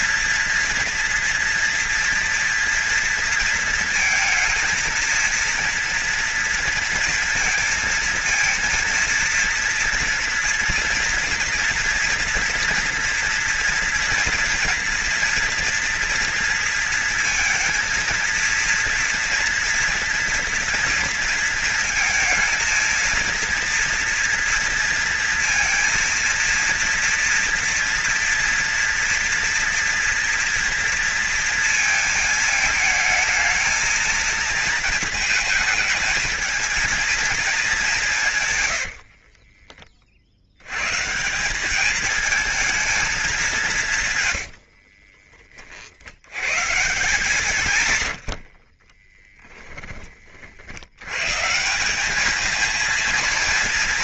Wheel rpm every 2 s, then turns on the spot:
230, 230, 220, 230, 230, 230, 230, 230, 230, 230, 230, 220, 230, 230, 230, 230, 220, 230, 220, 100, 110, 220, 60, 160, 40, 90, 220.
38-40 44-46 48-50